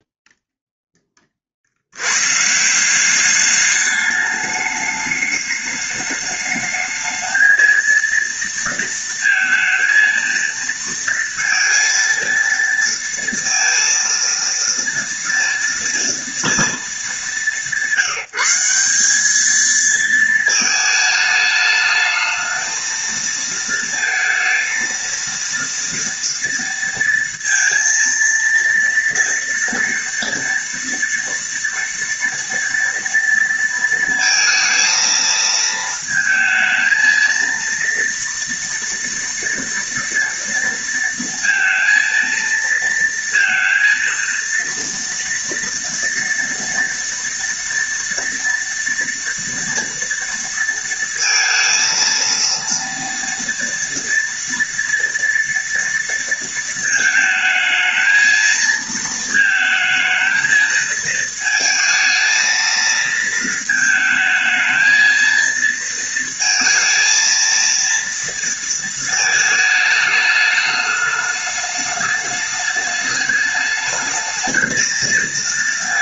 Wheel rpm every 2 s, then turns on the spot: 0, 160, 210, 210, 230, 230, 230, 230, 220, 190, 220, 220, 230, 230, 230, 230, 230, 230, 220, 230, 230, 230, 230, 230, 230, 230, 230, 230, 230, 230, 220, 230, 220, 230, 230, 210, 210, 220.
none